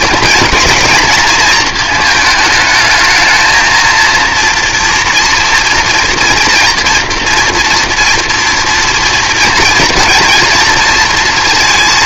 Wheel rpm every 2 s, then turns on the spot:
230, 220, 230, 240, 230, 230.
none